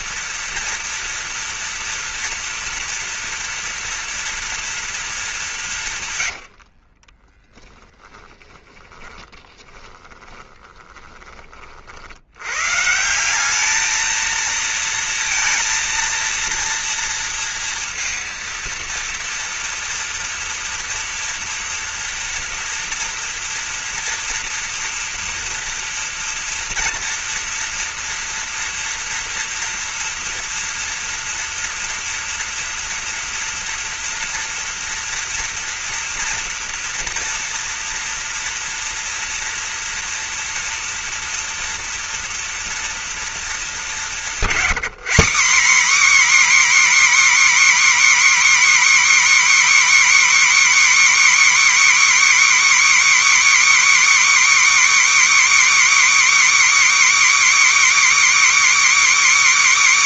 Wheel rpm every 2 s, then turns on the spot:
240, 230, 220, 50, 20, 20, 140, 230, 230, 230, 230, 230, 240, 230, 240, 240, 230, 230, 230, 240, 240, 230, 210, 300, 300, 300, 300, 310, 310, 310.
6-12